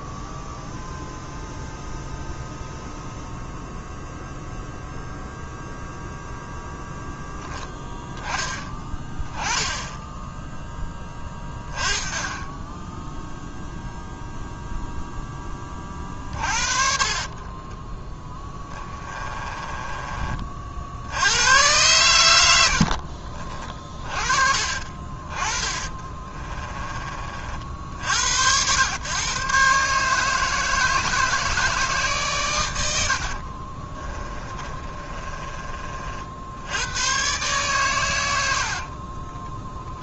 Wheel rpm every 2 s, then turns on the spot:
0, 0, 0, 0, 10, 10, 10, 0, 40, 10, 60, 70, 40, 20, 110, 160, 100, 30, 90, 60.
16-20 22-24 26-28 34-36 38-40